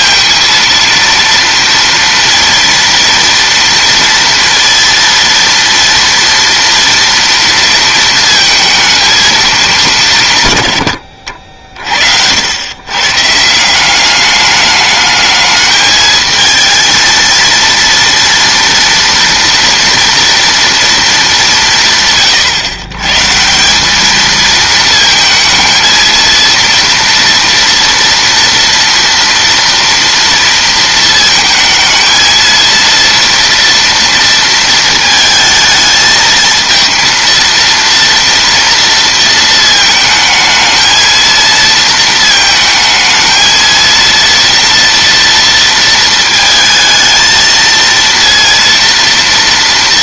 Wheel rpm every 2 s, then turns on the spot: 230, 230, 230, 230, 220, 130, 100, 210, 220, 240, 240, 120, 220, 230, 230, 230, 230, 230, 220, 230, 220, 220, 230, 220, 230.
none